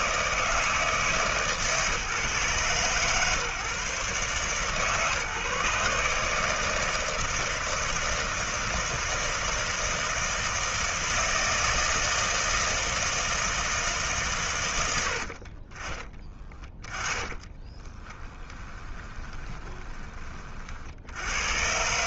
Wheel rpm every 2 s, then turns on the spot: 160, 130, 140, 160, 160, 160, 160, 80, 10, 10, 60.
16-20